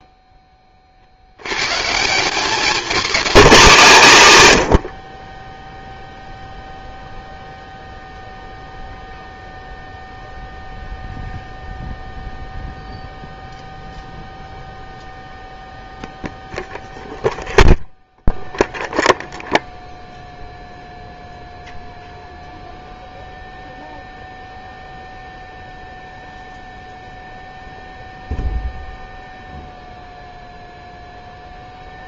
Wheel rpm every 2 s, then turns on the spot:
20, 200, 120, 0, 0, 0, 0, 0, 0, 0, 0, 0, 0, 0, 0, 0.
none